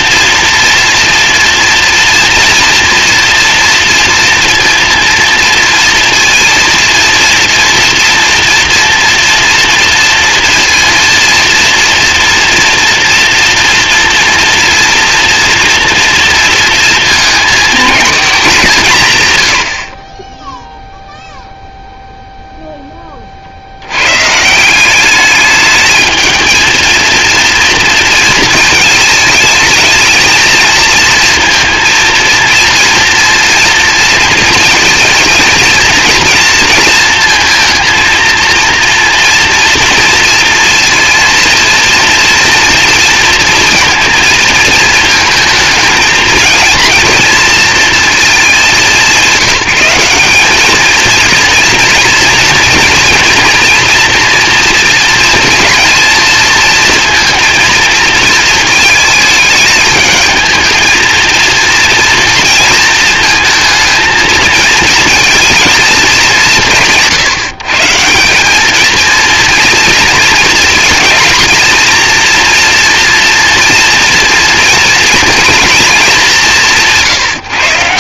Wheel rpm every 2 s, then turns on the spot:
230, 230, 230, 230, 230, 230, 230, 240, 230, 180, 0, 10, 180, 230, 220, 230, 230, 230, 230, 230, 230, 230, 220, 230, 180, 220, 230, 230, 230, 220, 220, 230, 230, 170, 220, 230, 240, 230, 170.
none